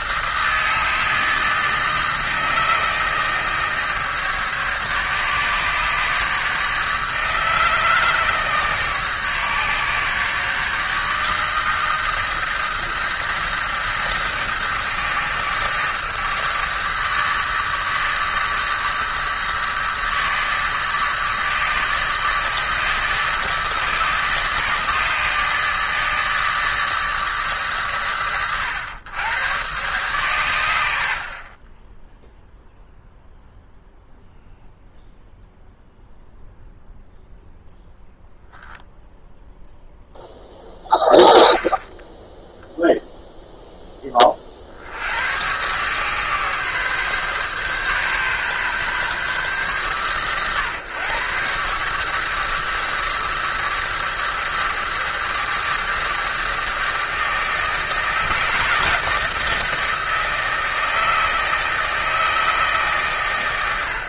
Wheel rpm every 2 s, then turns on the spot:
160, 160, 150, 150, 150, 150, 160, 160, 160, 150, 150, 150, 150, 150, 100, 100, 0, 0, 0, 0, 10, 0, 60, 140, 130, 120, 150, 160, 160, 160, 160, 140.
none